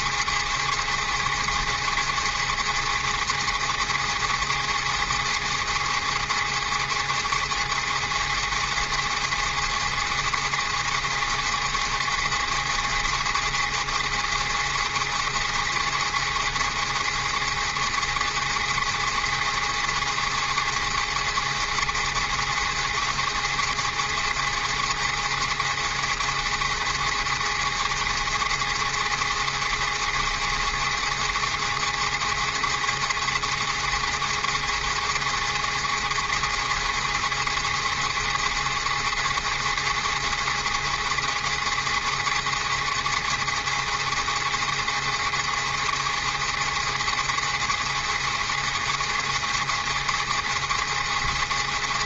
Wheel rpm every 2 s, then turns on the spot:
290, 290, 290, 290, 290, 290, 290, 290, 290, 290, 290, 290, 290, 290, 290, 290, 290, 290, 290, 290, 290, 290, 290, 290, 290, 290.
none